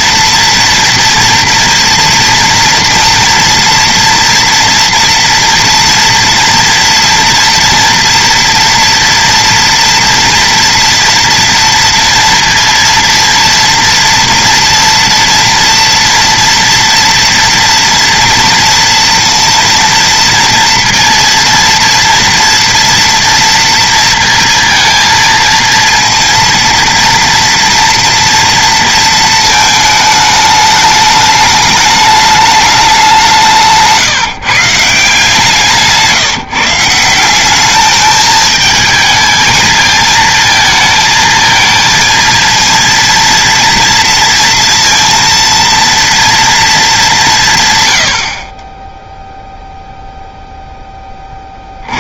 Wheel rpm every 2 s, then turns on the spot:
240, 240, 230, 230, 230, 230, 230, 230, 230, 230, 230, 230, 230, 240, 230, 210, 210, 150, 160, 220, 220, 230, 230, 220, 20, 10.
none